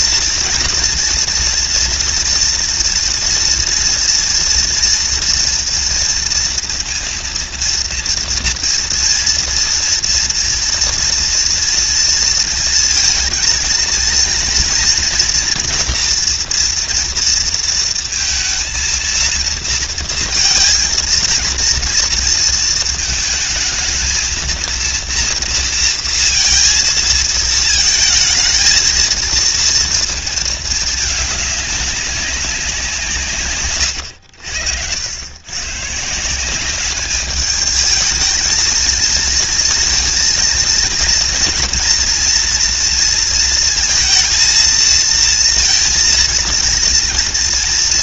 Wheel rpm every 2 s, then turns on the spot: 230, 230, 230, 230, 230, 230, 230, 230, 230, 230, 220, 220, 230, 230, 220, 220, 170, 90, 200, 220, 230, 230, 230, 230.
none